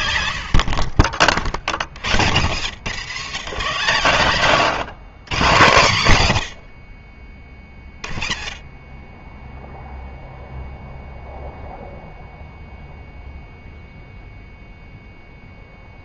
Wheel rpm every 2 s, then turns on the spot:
60, 130, 170, 50, 20, 0, 0, 0.
0-2